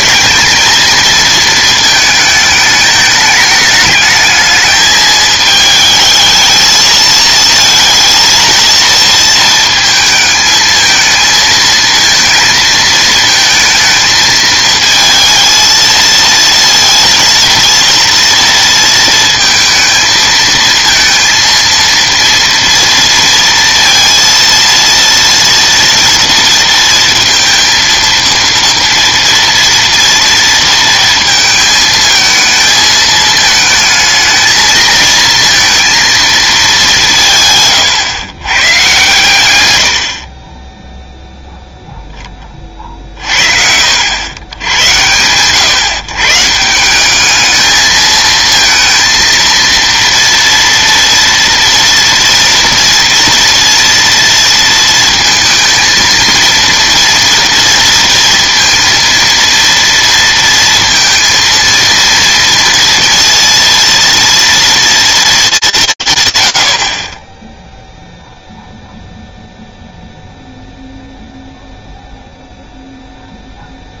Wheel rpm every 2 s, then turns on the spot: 220, 220, 220, 220, 230, 220, 230, 220, 230, 230, 220, 230, 230, 230, 230, 230, 220, 220, 210, 120, 20, 30, 100, 160, 230, 230, 230, 230, 230, 230, 230, 230, 230, 50, 0, 0, 0.
none